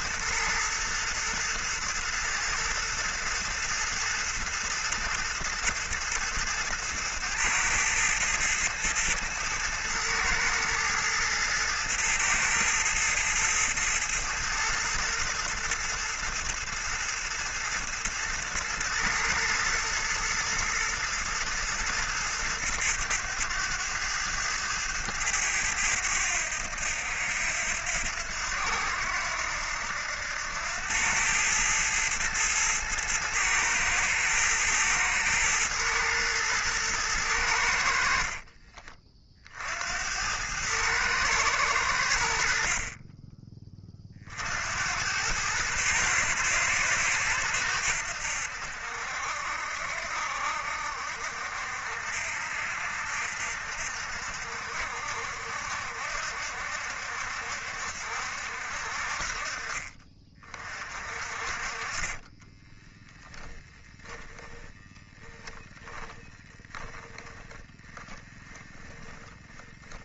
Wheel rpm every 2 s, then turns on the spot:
110, 110, 110, 110, 110, 110, 110, 110, 110, 110, 110, 110, 100, 90, 80, 90, 110, 110, 110, 40, 100, 50, 80, 110, 70, 60, 60, 60, 70, 60, 40, 10, 10, 20, 10.
38-40 62-70